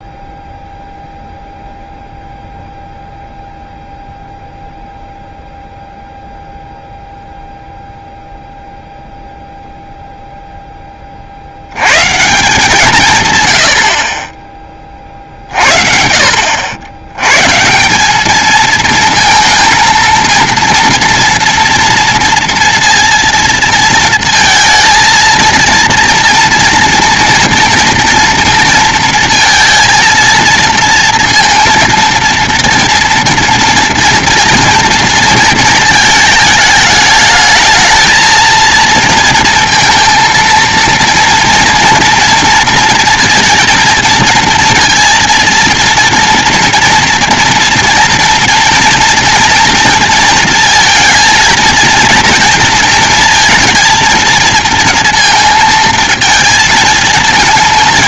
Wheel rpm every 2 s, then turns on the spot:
0, 0, 0, 0, 0, 20, 150, 30, 70, 220, 230, 230, 230, 240, 230, 230, 230, 230, 210, 230, 230, 230, 230, 230, 230, 230, 230, 220, 220.
none